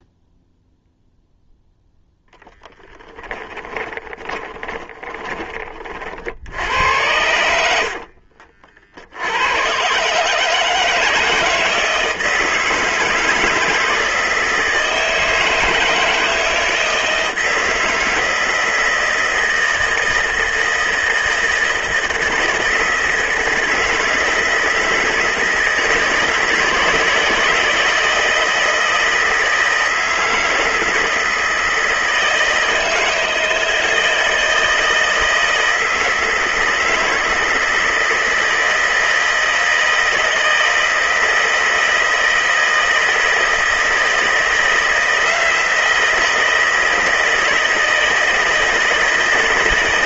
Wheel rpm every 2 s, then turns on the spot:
0, 10, 30, 90, 60, 160, 160, 160, 160, 160, 160, 160, 160, 160, 160, 160, 160, 160, 160, 160, 160, 160, 170, 160, 160.
4-6